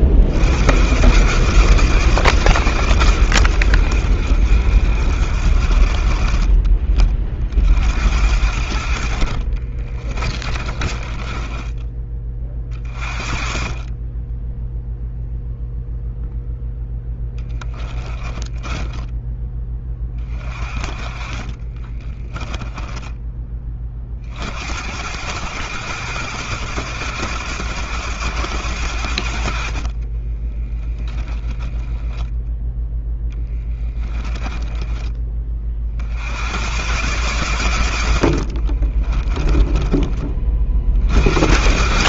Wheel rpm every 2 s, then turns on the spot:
80, 140, 70, 40, 70, 40, 50, 20, 0, 10, 30, 10, 60, 110, 100, 20, 0, 20, 80, 90, 30.
10-12 18-20 22-24 30-32 34-36 38-40